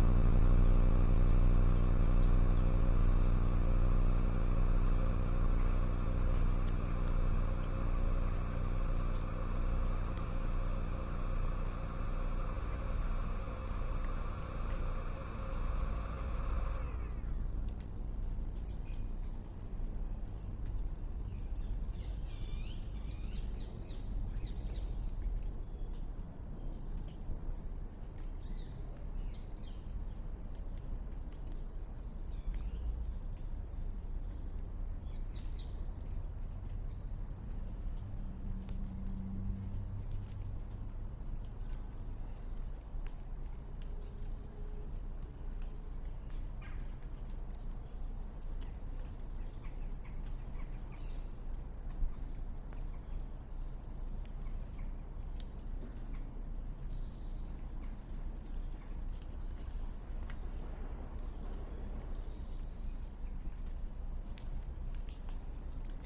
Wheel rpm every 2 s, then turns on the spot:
0, 0, 0, 0, 0, 0, 0, 0, 0, 0, 0, 0, 0, 0, 0, 0, 0, 0, 0, 0, 0, 0, 0, 0, 0, 0, 0, 0, 0, 0, 0, 0, 0.
none